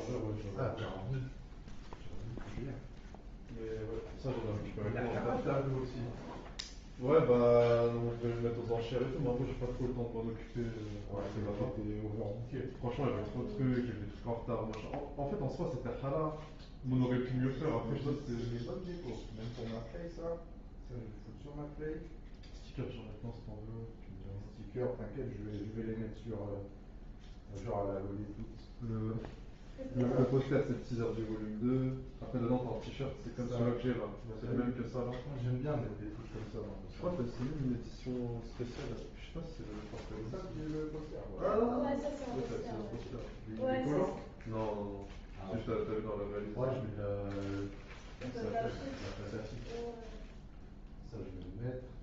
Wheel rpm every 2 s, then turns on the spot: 0, 0, 0, 0, 0, 0, 0, 0, 0, 0, 0, 0, 0, 0, 0, 0, 0, 0, 0, 0, 0, 0, 0, 0, 0, 0.
none